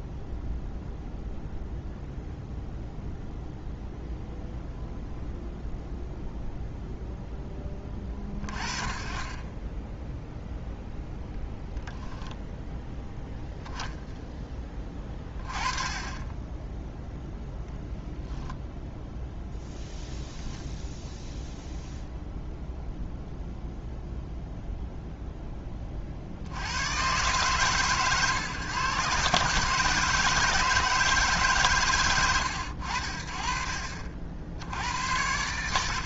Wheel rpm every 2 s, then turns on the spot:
0, 0, 0, 0, 40, 0, 0, 10, 10, 0, 0, 0, 0, 80, 130, 160, 110, 90.
none